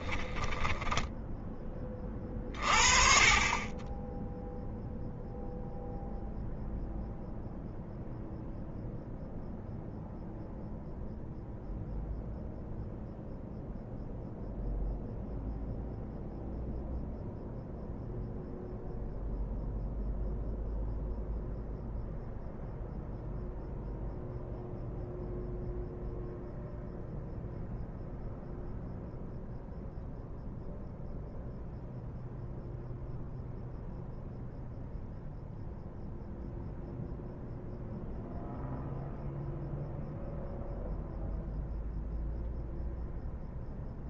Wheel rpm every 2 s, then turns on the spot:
10, 50, 0, 0, 0, 0, 0, 0, 0, 0, 0, 0, 0, 0, 0, 0, 0, 0, 0, 0, 0, 0.
none